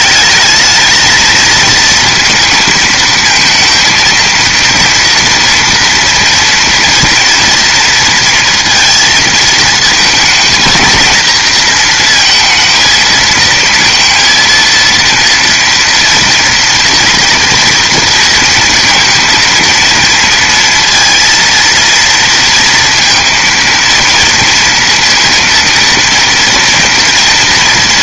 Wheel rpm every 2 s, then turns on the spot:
220, 230, 230, 230, 230, 230, 230, 230, 240, 230, 230, 230, 230, 230.
none